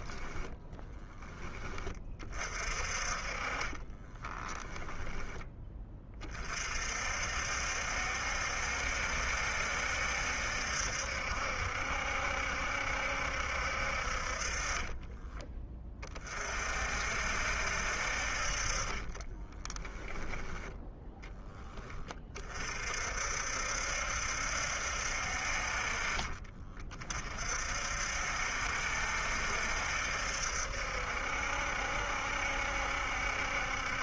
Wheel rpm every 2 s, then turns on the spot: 20, 40, 10, 50, 70, 70, 70, 20, 60, 20, 10, 50, 60, 40, 70, 70, 70.
2-6 14-16 18-20